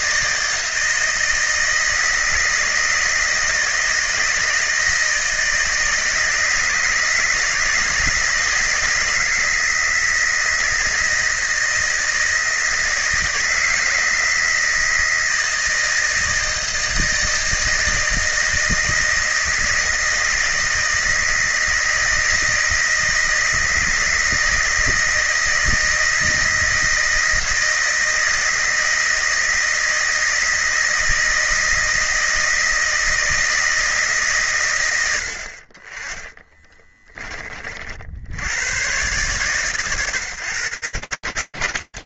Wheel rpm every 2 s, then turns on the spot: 160, 160, 160, 160, 160, 160, 160, 160, 160, 160, 160, 160, 160, 160, 160, 160, 160, 160, 40, 40, 100.
none